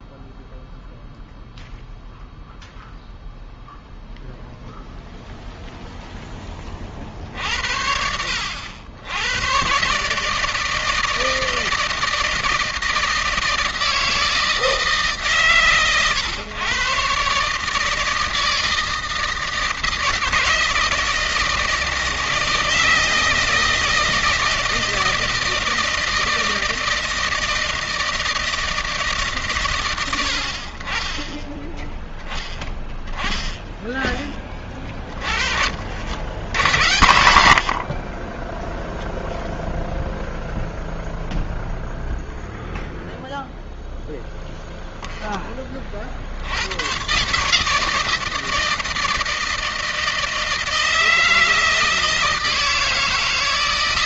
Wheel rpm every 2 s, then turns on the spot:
0, 0, 0, 20, 90, 150, 160, 160, 130, 160, 160, 160, 160, 160, 160, 70, 10, 20, 70, 20, 0, 0, 0, 70, 160, 160, 160.
none